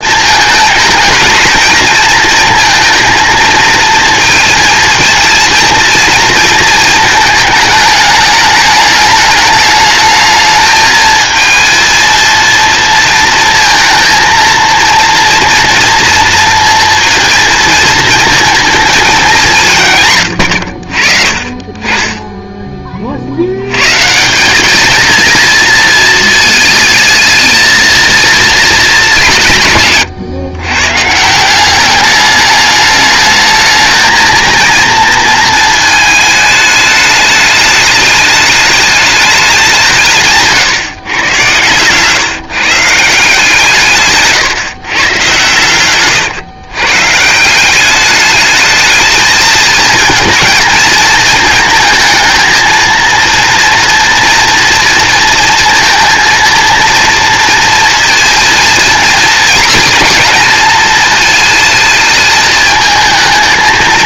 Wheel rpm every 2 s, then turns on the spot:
220, 230, 230, 230, 210, 220, 230, 230, 230, 230, 90, 20, 190, 220, 220, 130, 210, 230, 210, 210, 150, 150, 140, 110, 220, 230, 220, 230, 230, 230, 220, 220.
none